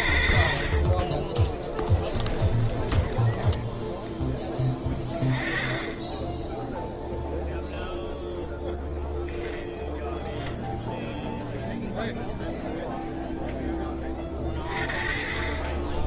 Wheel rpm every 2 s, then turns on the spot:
60, 10, 10, 10, 0, 0, 0, 40.
2-4